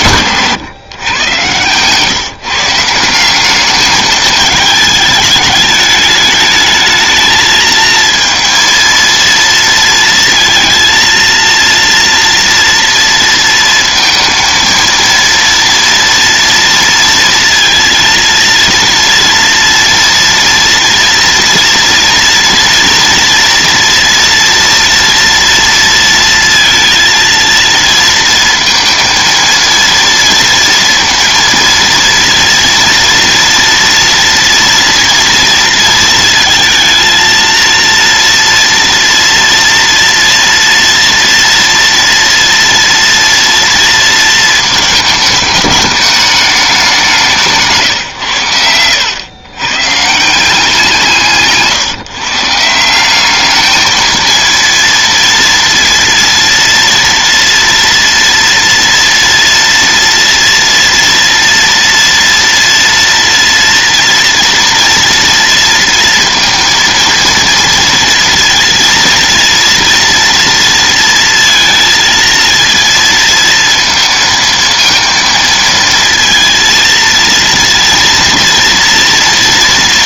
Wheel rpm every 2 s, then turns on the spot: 120, 180, 210, 220, 230, 230, 230, 230, 230, 230, 230, 240, 230, 230, 230, 230, 230, 230, 230, 230, 230, 230, 210, 160, 110, 170, 200, 230, 230, 230, 230, 230, 230, 230, 230, 230, 230, 230, 230, 240.
none